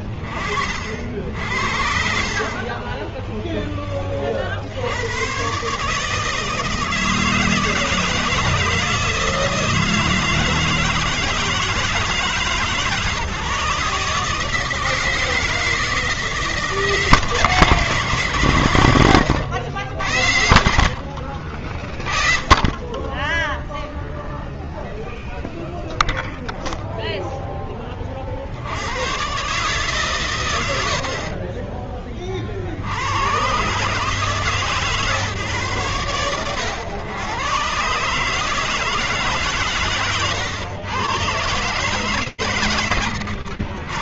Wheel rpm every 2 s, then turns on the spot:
60, 50, 40, 150, 160, 160, 150, 150, 170, 140, 70, 10, 0, 0, 110, 50, 100, 120, 110, 160, 120, 90.
none